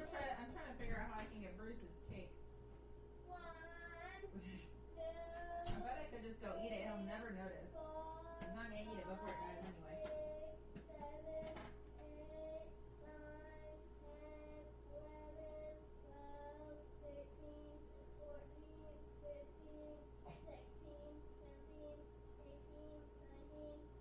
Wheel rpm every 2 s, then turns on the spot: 0, 0, 0, 0, 0, 0, 0, 0, 0, 0, 0, 0.
none